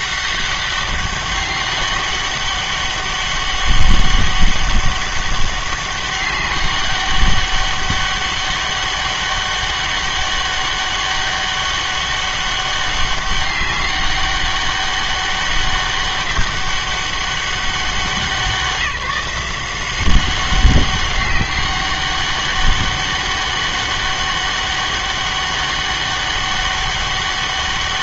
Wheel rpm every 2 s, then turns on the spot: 200, 200, 200, 200, 200, 200, 200, 200, 200, 170, 190, 200, 200, 200.
none